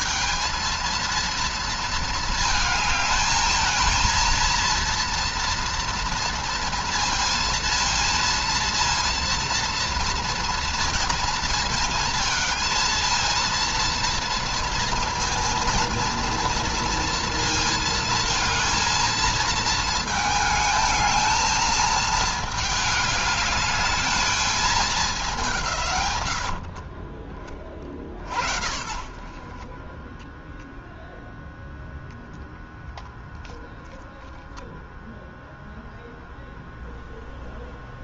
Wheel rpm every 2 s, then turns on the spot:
230, 220, 230, 230, 230, 230, 220, 230, 230, 230, 220, 210, 200, 40, 60, 0, 0, 0, 0.
none